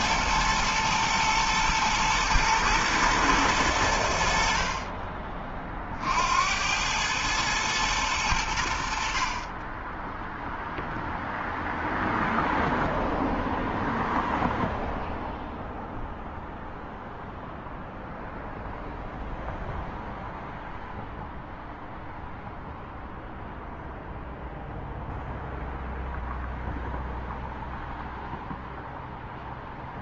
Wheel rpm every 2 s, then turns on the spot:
120, 110, 40, 110, 50, 0, 0, 0, 0, 0, 0, 0, 0, 0, 0.
none